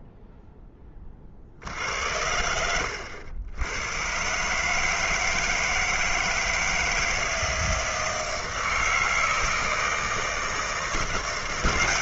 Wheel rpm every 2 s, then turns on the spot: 10, 90, 150, 160, 160, 170.
2-4